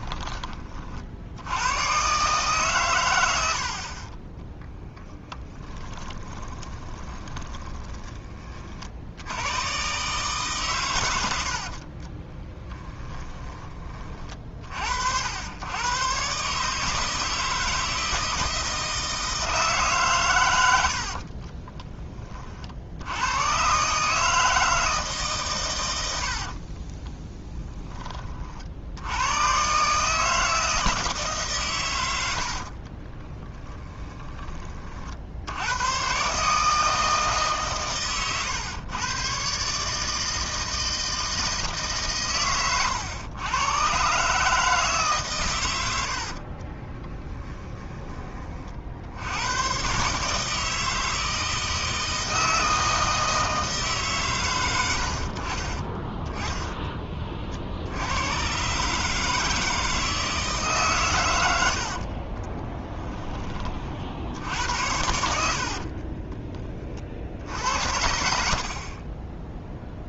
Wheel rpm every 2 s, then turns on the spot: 50, 120, 10, 20, 50, 130, 20, 70, 160, 160, 80, 70, 150, 30, 70, 160, 40, 40, 160, 130, 160, 110, 150, 30, 60, 160, 160, 80, 30, 140, 140, 10, 80, 40, 30.
4-8 12-14 20-22 26-28 32-34 46-48 62-66